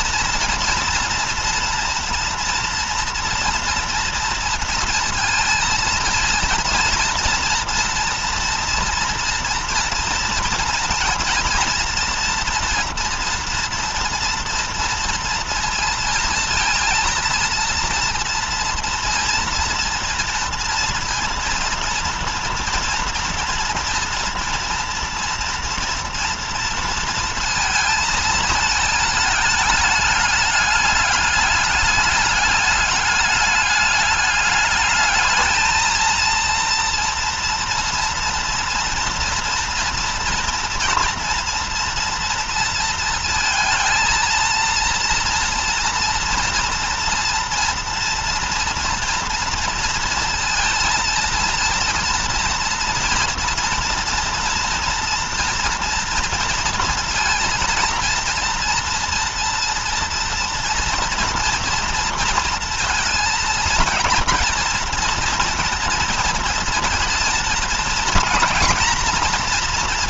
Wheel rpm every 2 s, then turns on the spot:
230, 230, 230, 230, 230, 230, 230, 230, 230, 230, 230, 230, 230, 230, 220, 210, 210, 210, 230, 230, 230, 230, 230, 240, 230, 230, 230, 230, 230, 230, 230, 230, 230, 230, 230.
none